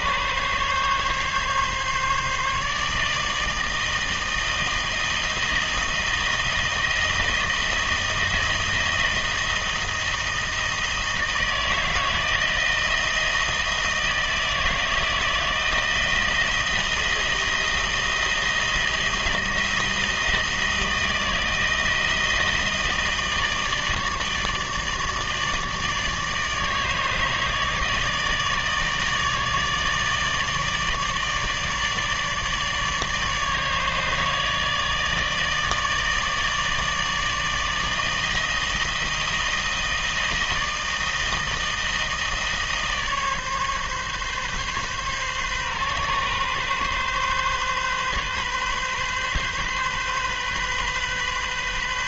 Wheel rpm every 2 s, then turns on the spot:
140, 160, 160, 160, 160, 160, 160, 160, 160, 160, 160, 160, 160, 160, 160, 160, 150, 160, 160, 160, 160, 150, 140, 130, 130, 130.
none